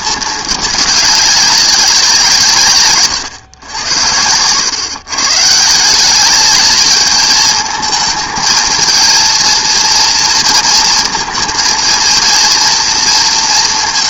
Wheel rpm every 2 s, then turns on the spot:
220, 150, 110, 210, 220, 230, 230.
none